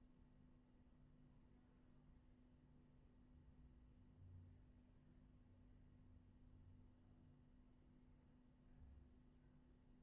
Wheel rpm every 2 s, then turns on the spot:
0, 0, 0, 0, 0.
none